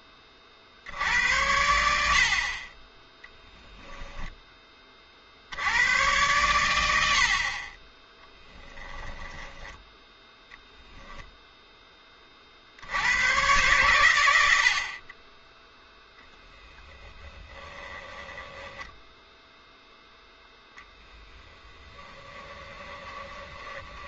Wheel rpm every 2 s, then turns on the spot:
50, 40, 20, 100, 10, 0, 60, 70, 10, 10, 10, 10.
8-10 16-24